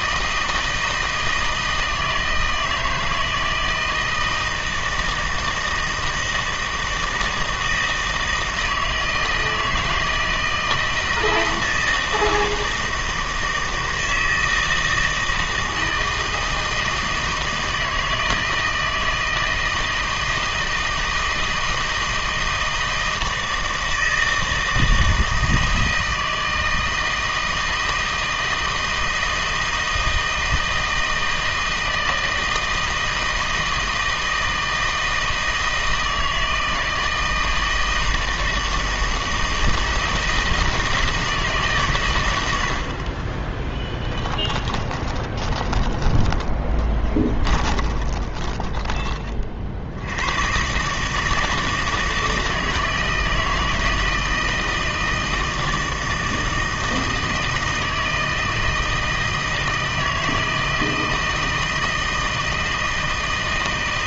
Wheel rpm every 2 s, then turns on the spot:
160, 160, 160, 160, 160, 160, 160, 160, 160, 160, 160, 160, 160, 160, 160, 160, 160, 160, 160, 160, 160, 70, 20, 20, 20, 140, 160, 160, 160, 160, 160, 160.
44-50